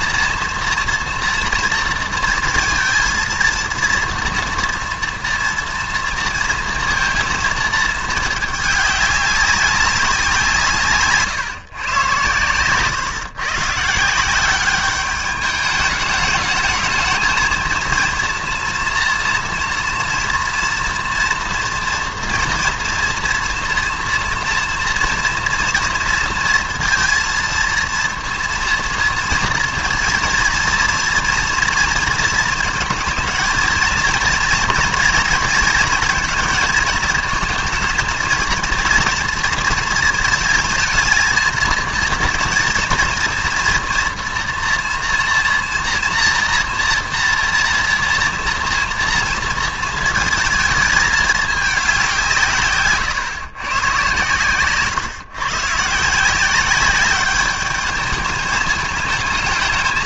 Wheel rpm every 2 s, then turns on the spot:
230, 230, 230, 230, 220, 160, 120, 190, 220, 230, 230, 240, 230, 230, 230, 230, 230, 230, 230, 230, 230, 230, 230, 230, 230, 220, 150, 120, 180, 210.
none